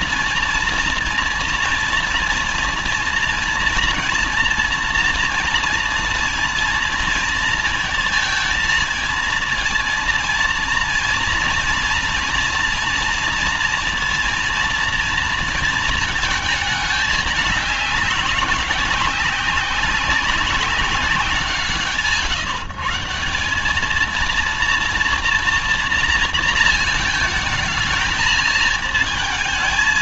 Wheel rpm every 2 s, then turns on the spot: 240, 230, 230, 230, 220, 230, 240, 230, 210, 190, 200, 150, 230, 230, 220.
none